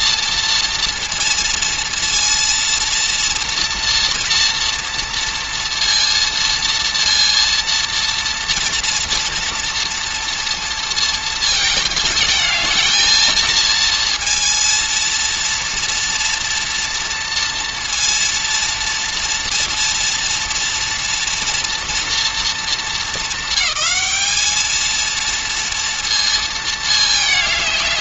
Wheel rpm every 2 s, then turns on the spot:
230, 230, 230, 230, 230, 230, 220, 230, 230, 230, 230, 220, 230, 230.
none